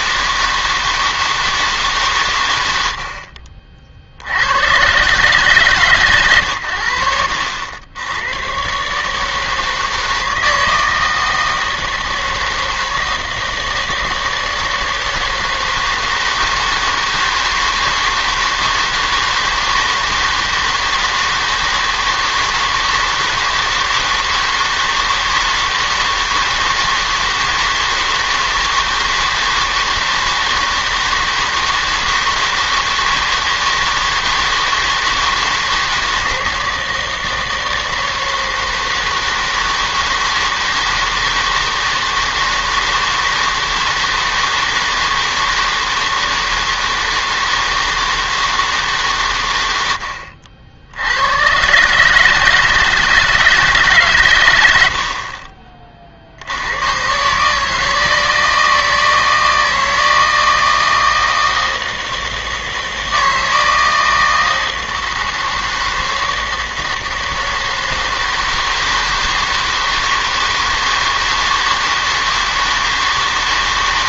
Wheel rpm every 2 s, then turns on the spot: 160, 90, 110, 90, 130, 160, 160, 160, 160, 160, 160, 160, 160, 160, 160, 160, 160, 160, 160, 160, 160, 160, 160, 160, 160, 70, 160, 90, 90, 160, 160, 160, 160, 160, 160, 160, 160.
none